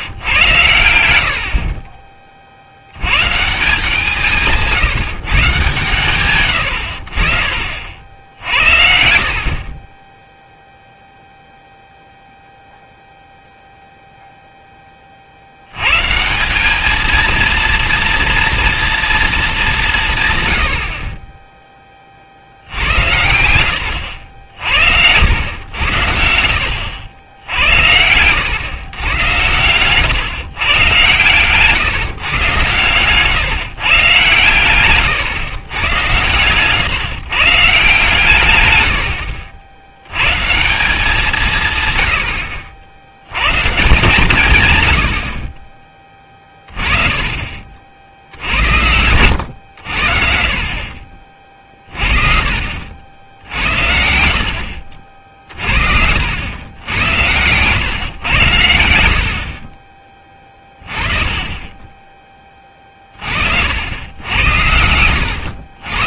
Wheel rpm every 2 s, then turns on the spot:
100, 60, 170, 100, 70, 0, 0, 10, 200, 240, 90, 70, 60, 70, 120, 120, 130, 120, 120, 120, 160, 80, 110, 20, 80, 40, 60, 70, 90, 90, 20, 20, 80.
36-38 60-64